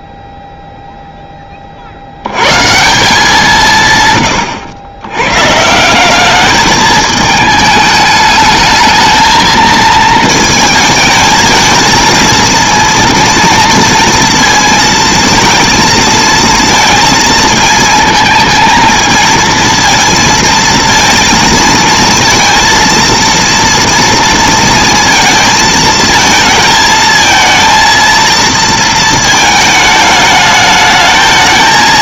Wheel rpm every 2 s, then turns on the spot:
0, 150, 110, 210, 220, 220, 230, 230, 230, 230, 230, 230, 230, 220, 230, 210.
none